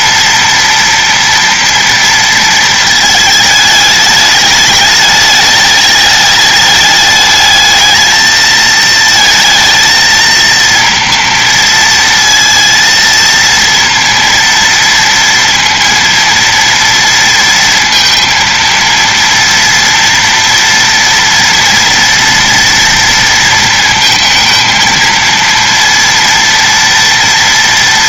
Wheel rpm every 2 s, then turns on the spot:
230, 220, 210, 210, 220, 230, 230, 230, 230, 230, 230, 230, 230, 230.
none